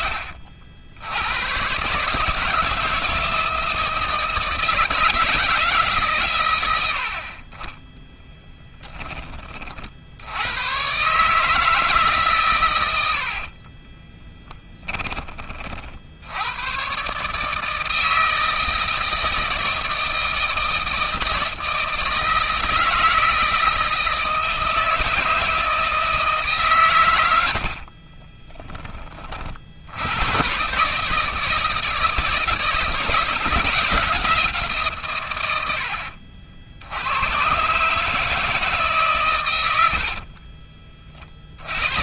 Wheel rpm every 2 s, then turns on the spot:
90, 160, 160, 60, 10, 140, 80, 20, 130, 160, 160, 160, 160, 110, 30, 150, 160, 140, 90, 140, 50.
12-14